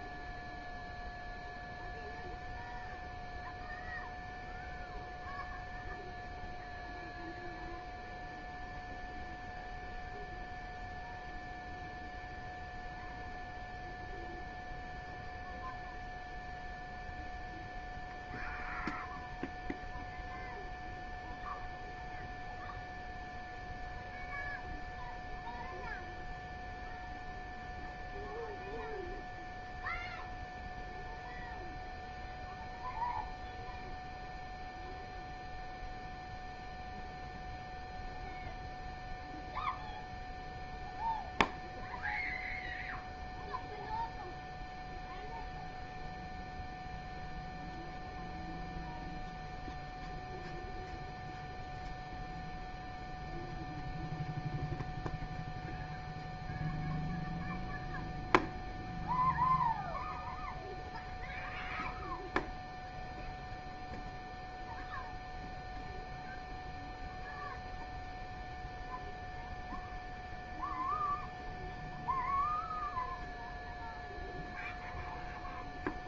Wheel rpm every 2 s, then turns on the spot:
0, 0, 0, 0, 0, 0, 0, 0, 0, 0, 0, 0, 0, 0, 0, 0, 0, 0, 0, 0, 0, 0, 0, 0, 0, 0, 0, 0, 0, 0, 0, 0, 0, 0, 0, 0, 0, 0.
none